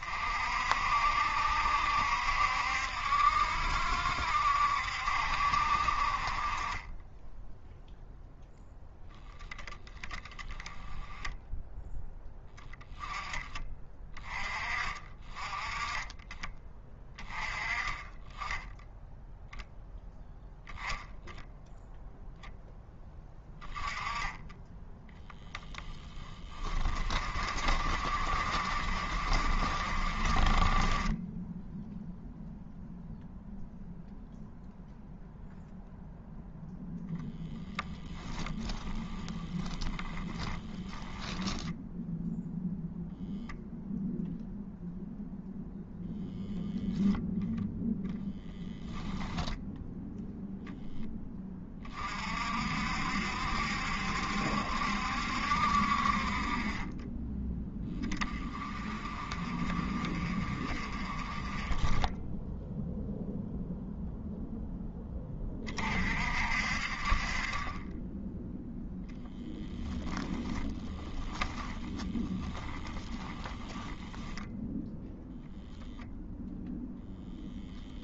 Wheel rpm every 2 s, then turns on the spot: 60, 70, 60, 20, 10, 10, 10, 30, 20, 10, 0, 10, 10, 30, 50, 20, 0, 0, 0, 10, 0, 0, 0, 0, 0, 10, 60, 70, 30, 30, 30, 0, 10, 50, 10, 10, 10, 0, 0.
26-32 38-40 70-74